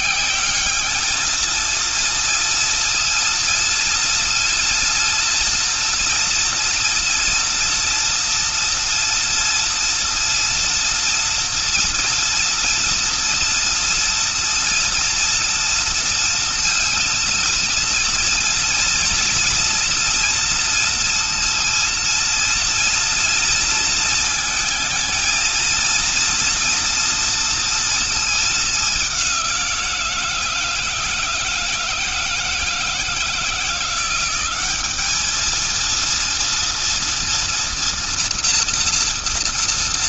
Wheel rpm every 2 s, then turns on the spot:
210, 230, 230, 240, 240, 240, 230, 230, 230, 230, 230, 230, 220, 230, 190, 160, 160, 210, 230, 230.
none